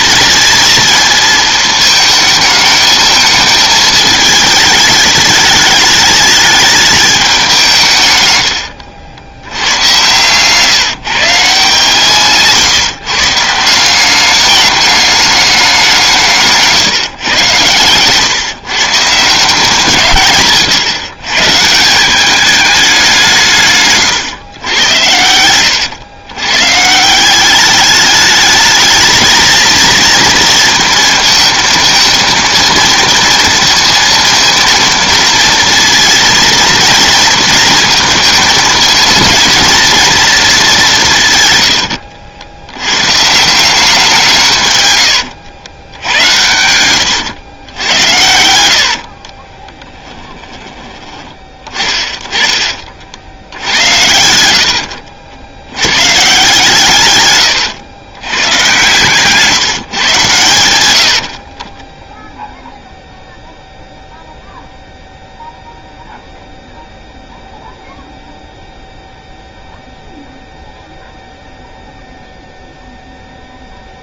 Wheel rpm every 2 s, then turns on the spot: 230, 220, 210, 210, 100, 140, 140, 210, 150, 140, 130, 200, 100, 130, 220, 230, 230, 230, 230, 220, 200, 80, 130, 100, 70, 10, 30, 80, 140, 120, 100, 0, 0, 0, 0, 0, 0.
46-50